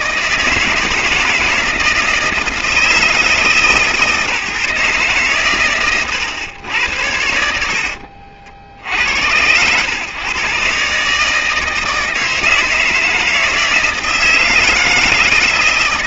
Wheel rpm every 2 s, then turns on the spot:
160, 160, 140, 100, 70, 140, 160, 160.
none